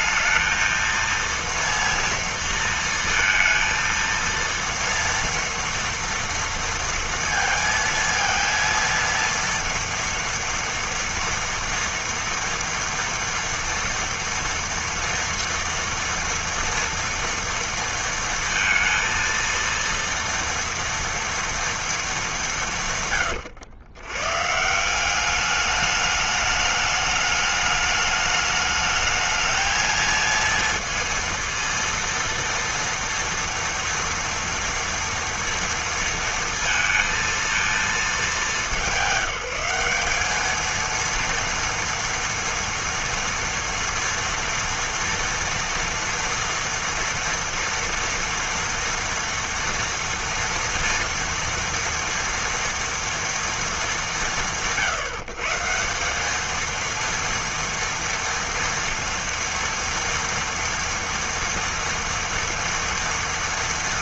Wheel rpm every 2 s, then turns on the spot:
230, 230, 230, 230, 230, 230, 230, 230, 230, 230, 230, 170, 160, 210, 210, 230, 230, 230, 230, 190, 220, 230, 230, 230, 230, 230, 230, 140, 220, 230, 230, 230.
none